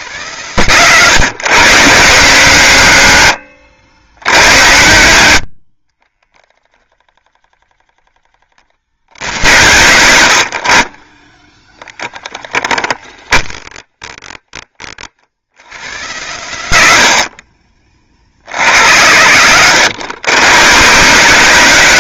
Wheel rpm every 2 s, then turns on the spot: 140, 150, 90, 10, 70, 70, 10, 30, 110, 100, 140.
12-14